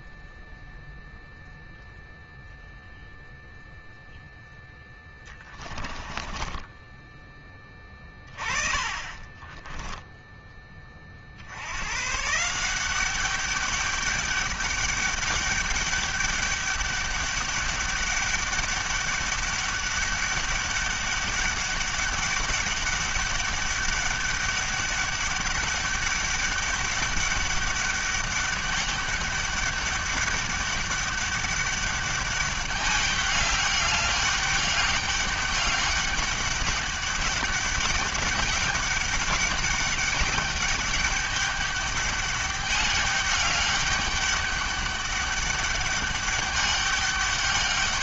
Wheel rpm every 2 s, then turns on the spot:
0, 0, 20, 10, 10, 90, 200, 200, 200, 200, 200, 200, 200, 200, 200, 200, 200, 200, 200, 200, 200, 200, 200, 200.
4-6 8-10